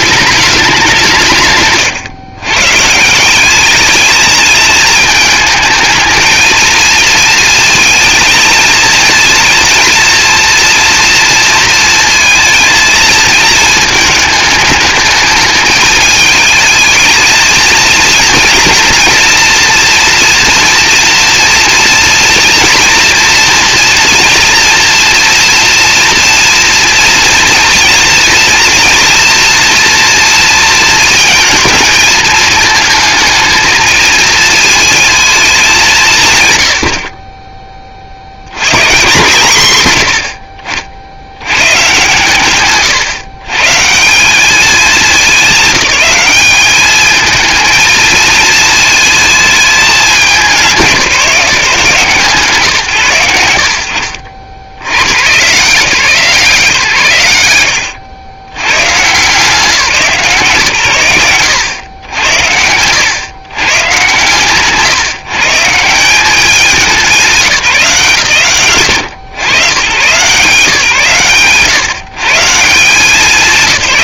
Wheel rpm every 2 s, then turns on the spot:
180, 160, 220, 220, 230, 230, 230, 220, 210, 230, 230, 230, 230, 230, 230, 230, 220, 220, 80, 150, 50, 150, 200, 210, 230, 180, 130, 80, 130, 100, 120, 100, 140, 190, 100, 130, 170.
none